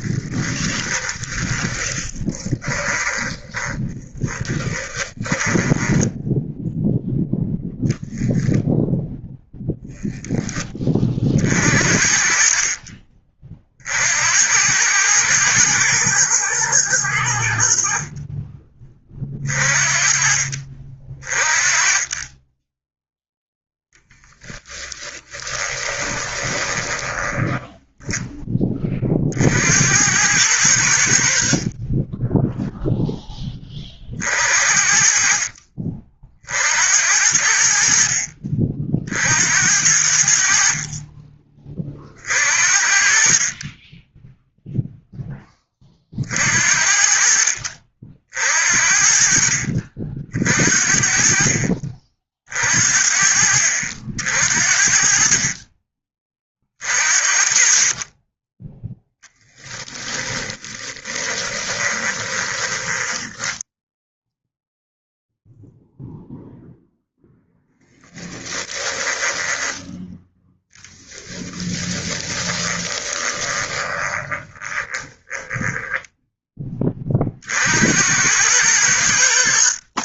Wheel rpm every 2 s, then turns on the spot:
10, 20, 10, 0, 0, 30, 30, 100, 100, 30, 40, 10, 20, 20, 30, 80, 0, 50, 70, 50, 40, 50, 0, 60, 50, 50, 50, 50, 40, 0, 20, 20, 0, 0, 10, 20, 20, 20, 30, 80.
0-6 24-28 60-64 68-76